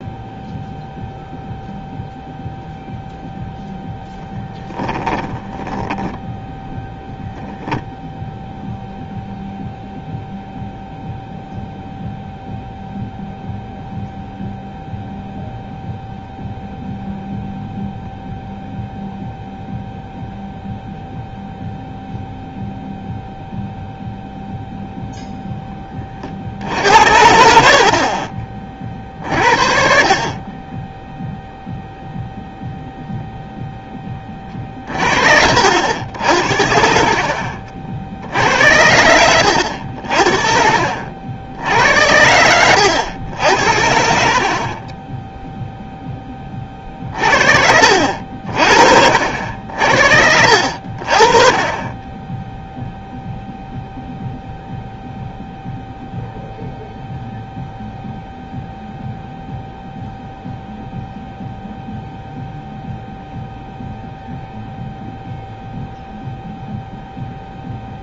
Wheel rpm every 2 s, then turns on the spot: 0, 0, 10, 0, 0, 0, 0, 0, 0, 0, 0, 0, 0, 60, 30, 20, 0, 30, 60, 80, 50, 90, 40, 30, 50, 60, 0, 0, 0, 0, 0, 0, 0, 0.
4-6